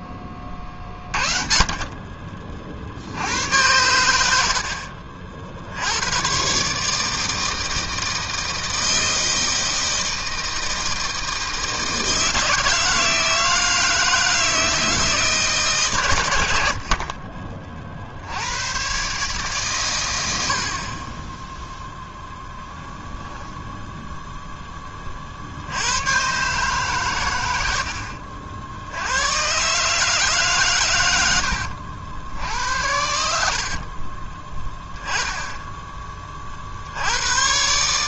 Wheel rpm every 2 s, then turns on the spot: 30, 80, 60, 160, 160, 160, 160, 150, 40, 140, 20, 10, 70, 70, 130, 80, 60, 10, 130.
16-18 22-24 26-28 30-34